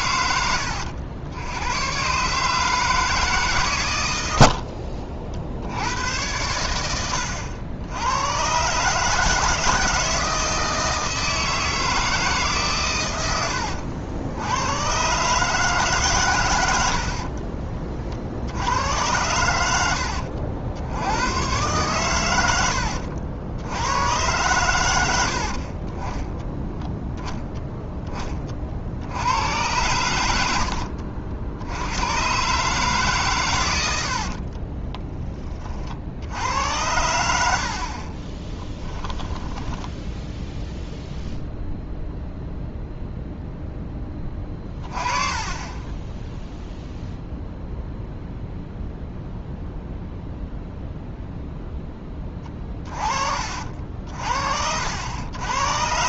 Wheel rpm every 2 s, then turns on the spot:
80, 150, 60, 100, 130, 160, 130, 100, 100, 80, 70, 90, 100, 0, 50, 70, 140, 30, 90, 10, 0, 0, 20, 0, 0, 0, 20, 60.
4-6 34-36 38-40